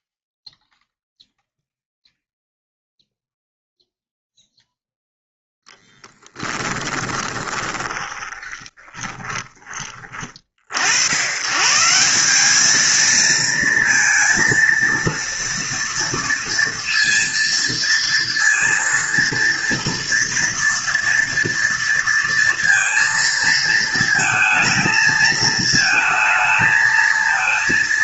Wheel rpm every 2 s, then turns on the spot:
0, 0, 0, 10, 20, 30, 170, 230, 230, 230, 230, 230, 230, 220.
6-10